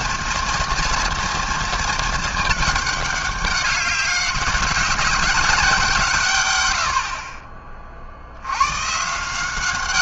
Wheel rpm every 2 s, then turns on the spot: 230, 220, 200, 140, 80.
none